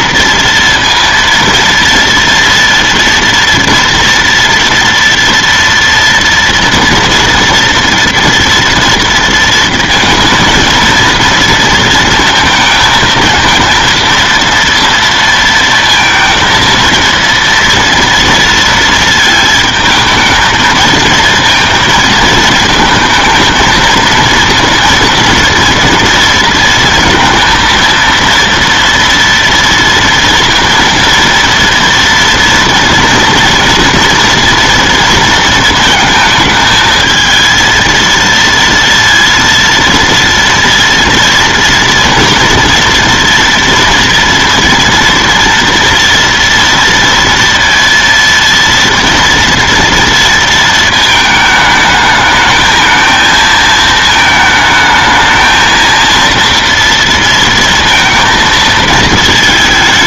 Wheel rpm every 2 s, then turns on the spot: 230, 230, 230, 230, 230, 230, 220, 230, 230, 230, 220, 220, 230, 230, 230, 230, 240, 230, 220, 230, 230, 240, 230, 230, 230, 230, 220, 220, 230, 220.
none